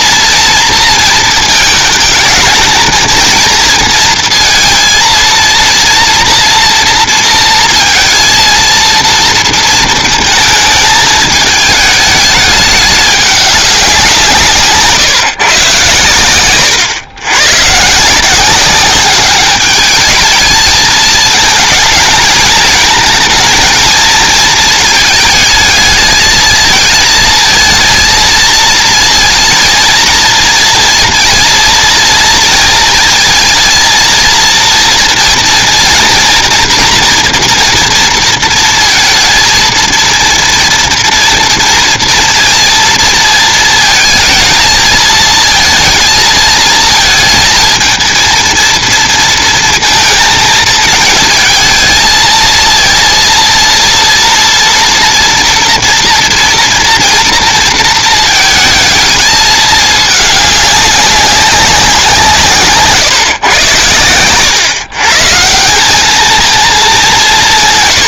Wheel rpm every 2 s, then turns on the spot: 230, 220, 230, 230, 230, 220, 210, 170, 110, 190, 220, 220, 220, 220, 230, 230, 230, 230, 230, 230, 230, 230, 220, 220, 230, 220, 230, 230, 230, 230, 210, 150, 120, 220.
none